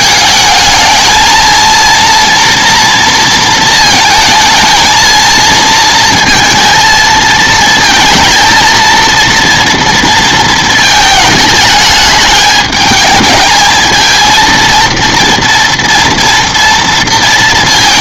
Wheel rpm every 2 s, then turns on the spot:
220, 230, 220, 220, 220, 220, 210, 230, 230.
none